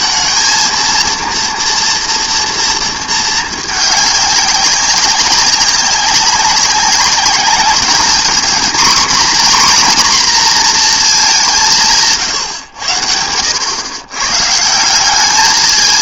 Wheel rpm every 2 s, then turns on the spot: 220, 230, 200, 200, 240, 240, 120, 150.
none